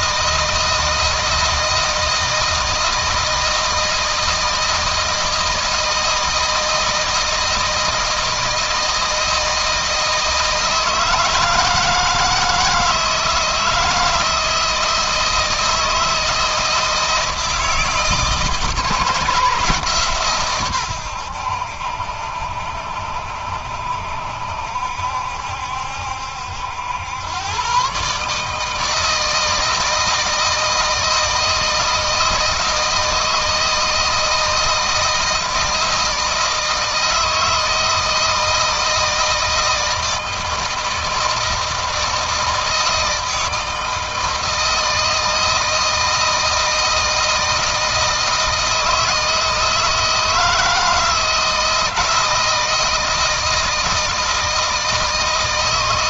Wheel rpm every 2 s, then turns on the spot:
160, 160, 160, 160, 160, 160, 160, 160, 160, 160, 110, 70, 70, 90, 160, 160, 160, 160, 160, 160, 160, 160, 160, 160, 160, 160, 160, 160.
none